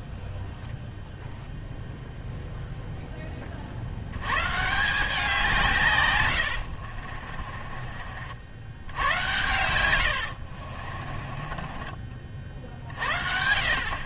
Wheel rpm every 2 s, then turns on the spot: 0, 40, 160, 30, 100, 20, 50.
6-8 10-12